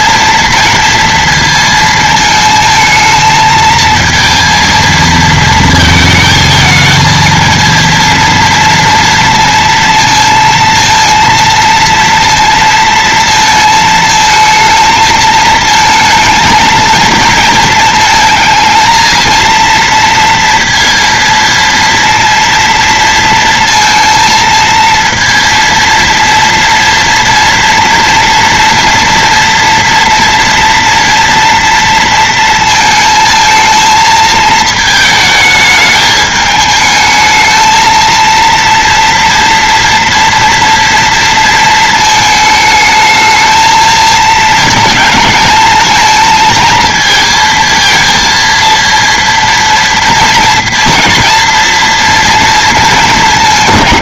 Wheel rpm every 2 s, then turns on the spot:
230, 220, 230, 220, 230, 230, 230, 220, 230, 230, 230, 230, 230, 230, 230, 230, 220, 220, 220, 230, 230, 220, 220, 230, 230, 230, 220.
none